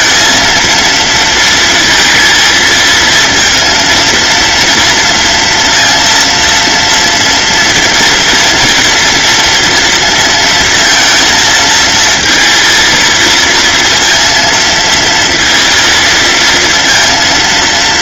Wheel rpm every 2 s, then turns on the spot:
230, 220, 230, 230, 240, 230, 230, 230, 230.
none